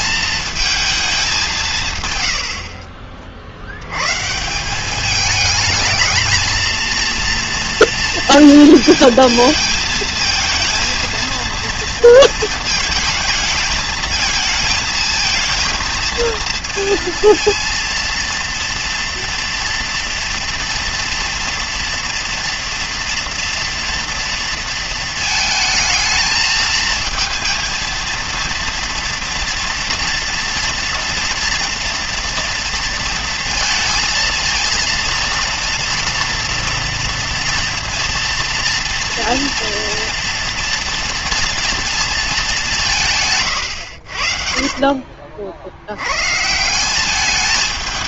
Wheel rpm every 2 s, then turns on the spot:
220, 60, 170, 220, 230, 230, 220, 220, 230, 230, 230, 230, 230, 220, 230, 230, 230, 230, 230, 240, 230, 200, 50, 180.
44-46